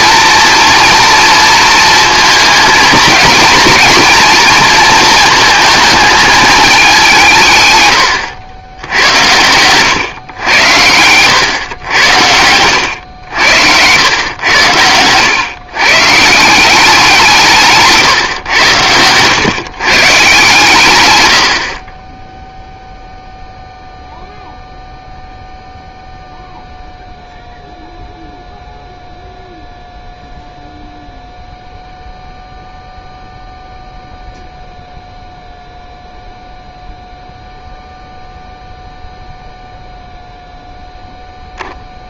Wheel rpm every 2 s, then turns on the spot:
230, 230, 220, 150, 110, 110, 80, 120, 160, 110, 70, 0, 0, 0, 0, 0, 0, 0, 0, 0, 0.
none